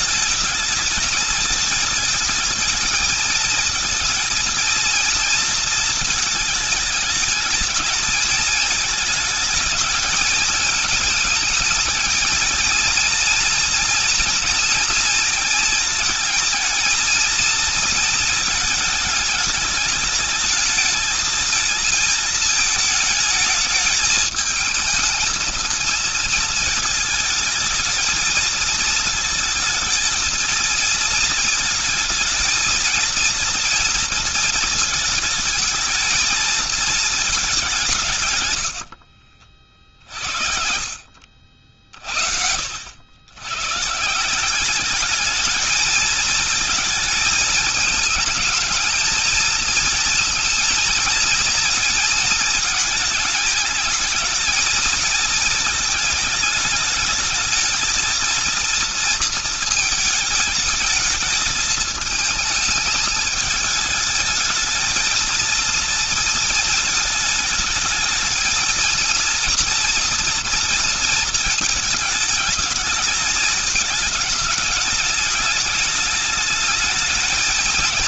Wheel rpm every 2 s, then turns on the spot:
210, 220, 230, 220, 220, 210, 230, 230, 220, 220, 220, 220, 220, 220, 220, 220, 230, 220, 220, 110, 60, 70, 200, 220, 220, 230, 220, 220, 220, 230, 220, 220, 220, 230, 220, 230, 220, 210, 220.
38-42